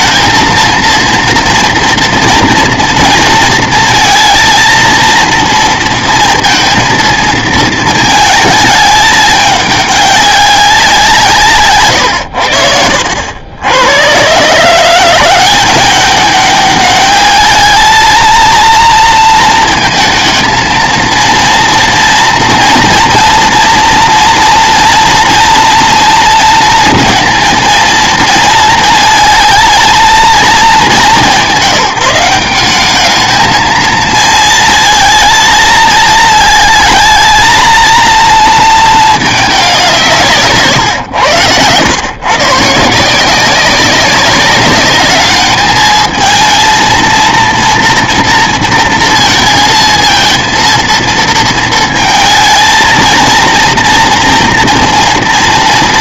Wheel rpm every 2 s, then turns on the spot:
230, 230, 230, 230, 220, 190, 70, 150, 200, 230, 220, 230, 230, 230, 220, 200, 200, 230, 220, 230, 140, 150, 200, 230, 230, 230, 230, 230.
40-42